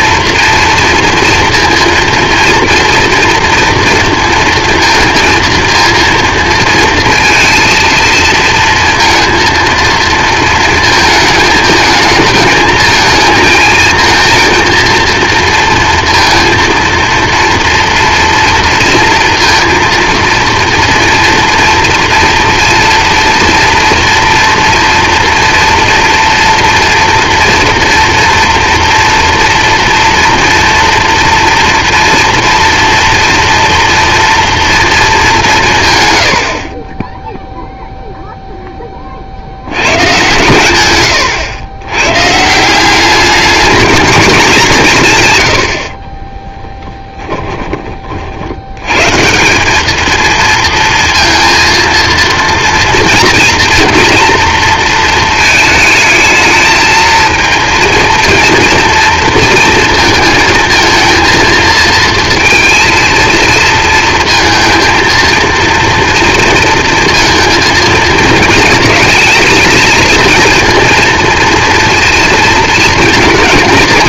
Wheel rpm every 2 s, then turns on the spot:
230, 230, 230, 230, 230, 220, 220, 230, 230, 230, 230, 230, 230, 240, 230, 230, 230, 230, 60, 10, 110, 180, 190, 20, 90, 230, 230, 230, 220, 230, 230, 230, 230, 230, 220, 230, 230.
46-48